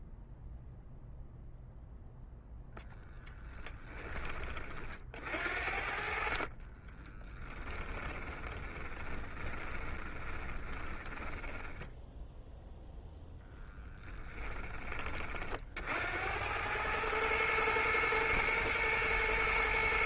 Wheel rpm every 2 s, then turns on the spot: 0, 0, 50, 30, 20, 20, 0, 20, 110, 120.
6-12